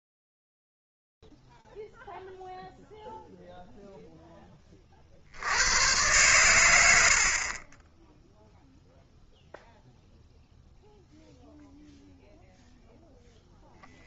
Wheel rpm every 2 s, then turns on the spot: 0, 0, 10, 110, 0, 0, 0.
none